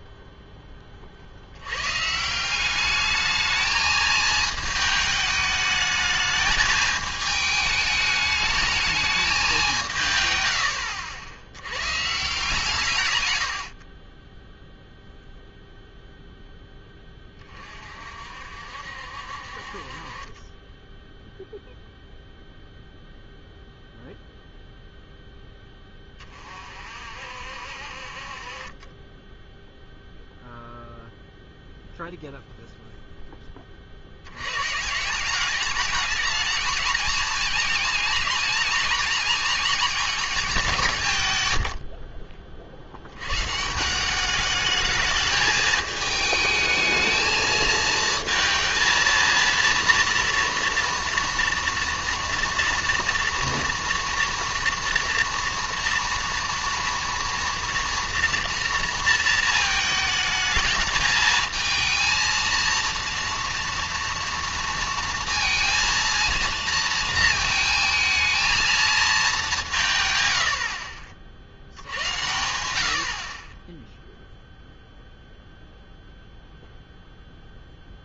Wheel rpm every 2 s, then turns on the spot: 10, 180, 220, 220, 210, 110, 150, 10, 10, 60, 20, 0, 0, 40, 40, 0, 0, 110, 220, 220, 190, 40, 210, 220, 230, 230, 230, 230, 230, 230, 220, 230, 230, 230, 220, 90, 80, 0, 0.
20-22